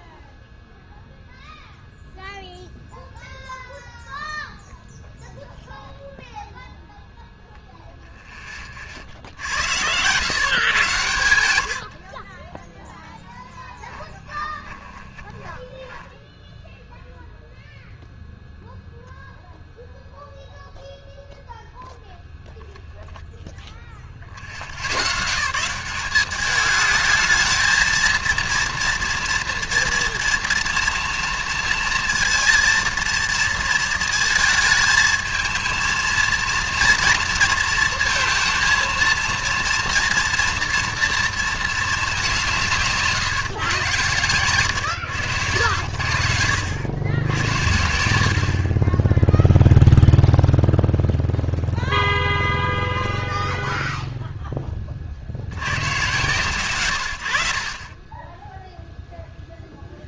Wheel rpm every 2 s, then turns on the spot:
0, 0, 0, 0, 30, 130, 10, 20, 0, 0, 0, 0, 80, 210, 240, 230, 230, 220, 230, 230, 230, 160, 120, 90, 40, 0, 0, 20, 120, 0.
14-16